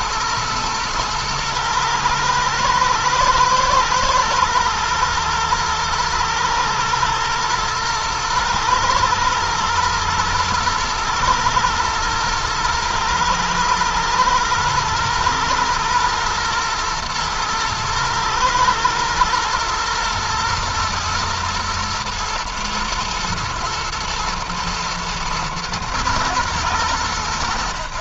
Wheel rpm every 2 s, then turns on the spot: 110, 110, 120, 110, 110, 110, 110, 110, 110, 110, 120, 110, 110, 110.
none